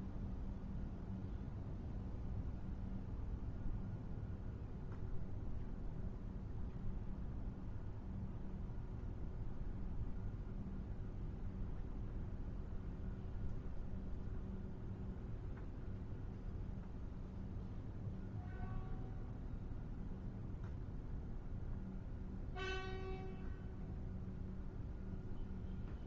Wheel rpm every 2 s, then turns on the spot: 0, 0, 0, 0, 0, 0, 0, 0, 0, 0, 0, 0, 0.
none